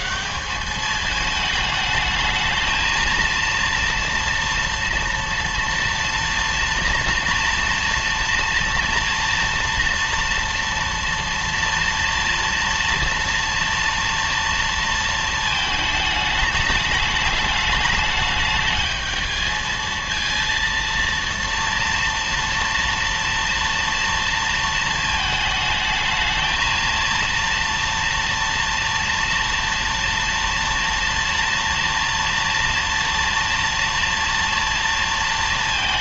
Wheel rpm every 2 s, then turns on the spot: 210, 220, 230, 230, 230, 230, 230, 230, 210, 220, 230, 230, 220, 220, 230, 230, 230, 230.
none